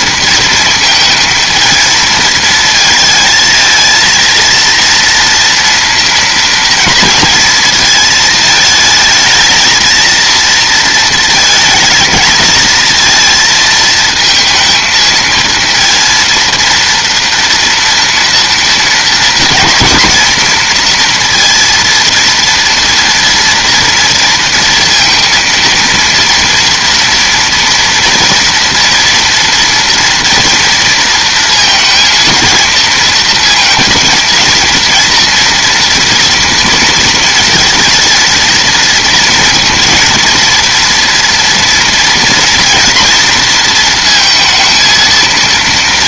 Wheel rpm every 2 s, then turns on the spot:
230, 230, 230, 230, 220, 230, 220, 230, 230, 230, 240, 230, 230, 230, 230, 230, 230, 230, 230, 230, 230, 230, 230.
none